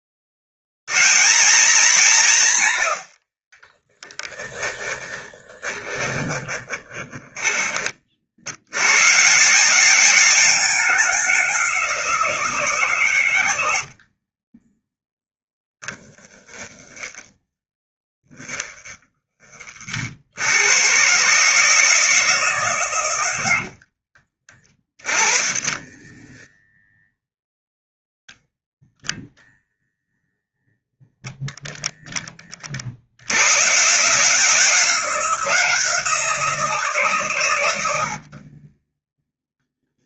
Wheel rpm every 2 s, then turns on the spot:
120, 100, 10, 20, 120, 200, 150, 10, 10, 20, 120, 140, 20, 0, 10, 0, 50, 180, 160, 10.
4-8 14-20 38-40